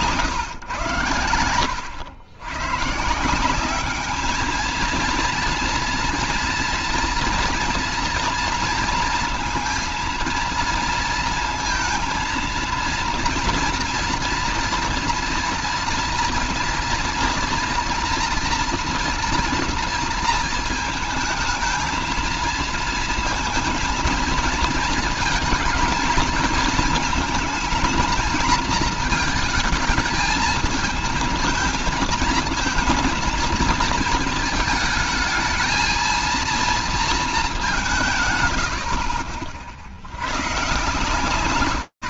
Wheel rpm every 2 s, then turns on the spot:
140, 120, 220, 240, 230, 230, 230, 230, 230, 240, 230, 230, 220, 220, 220, 220, 230, 230, 230, 130, 150.
none